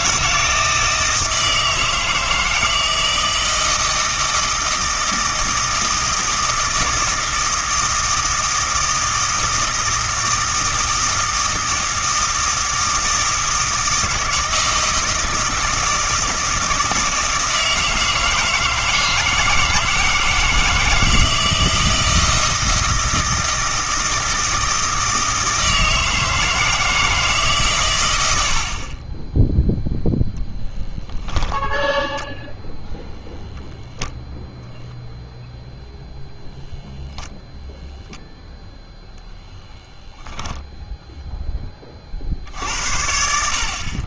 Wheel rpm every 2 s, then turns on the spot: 160, 160, 160, 160, 160, 160, 160, 160, 160, 160, 160, 160, 160, 160, 40, 10, 0, 0, 0, 0, 10, 70.
40-42